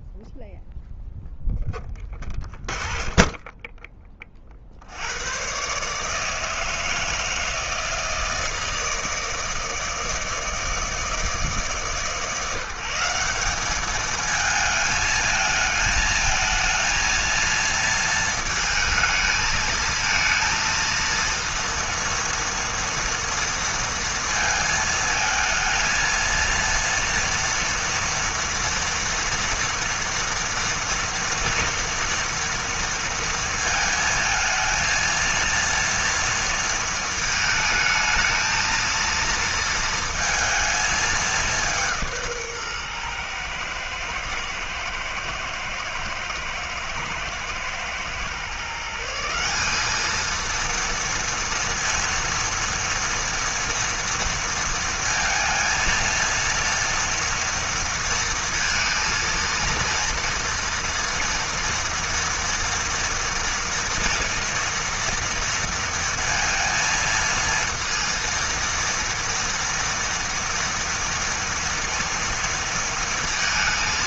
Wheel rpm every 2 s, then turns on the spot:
0, 20, 60, 160, 160, 160, 160, 220, 220, 220, 230, 230, 230, 230, 230, 230, 230, 220, 230, 220, 220, 140, 120, 110, 140, 230, 230, 230, 230, 230, 230, 230, 230, 230, 230, 230, 230.
none